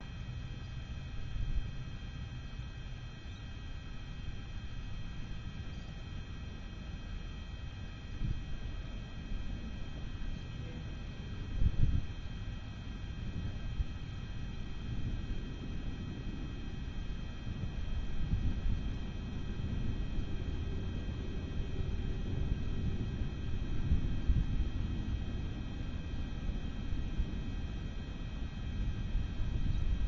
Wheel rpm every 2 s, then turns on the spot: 0, 0, 0, 0, 0, 0, 0, 0, 0, 0, 0, 0, 0, 0, 0.
none